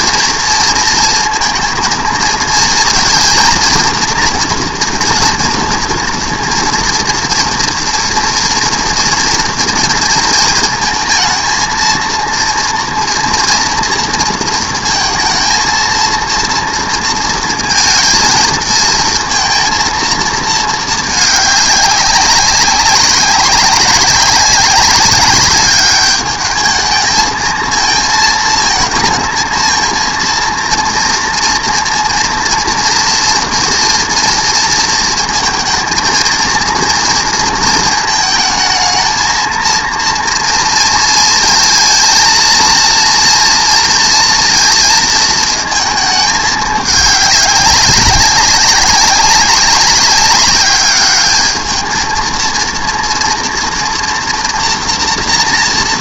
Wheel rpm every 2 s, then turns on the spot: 230, 230, 240, 230, 230, 220, 230, 230, 230, 220, 220, 190, 200, 210, 220, 230, 230, 230, 230, 220, 230, 230, 230, 210, 190, 200, 230, 230.
none